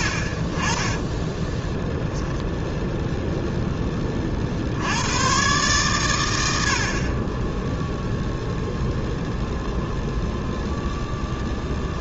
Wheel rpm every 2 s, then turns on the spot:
30, 0, 60, 80, 0, 0.
none